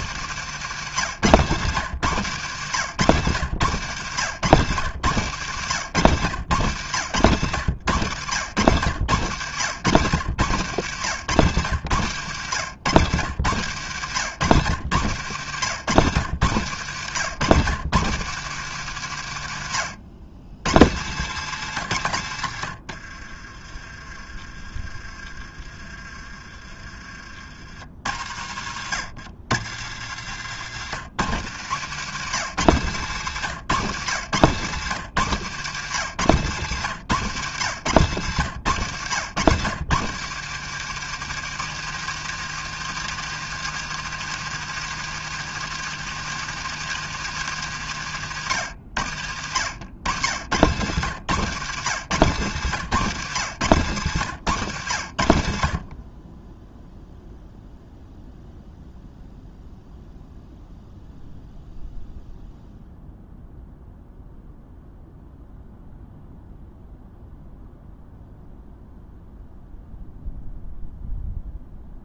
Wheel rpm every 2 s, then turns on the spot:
130, 120, 120, 110, 100, 110, 110, 110, 120, 110, 110, 40, 30, 40, 90, 120, 110, 120, 100, 110, 150, 160, 160, 160, 80, 110, 120, 80, 0, 0, 0, 0, 0, 0, 0, 0.
none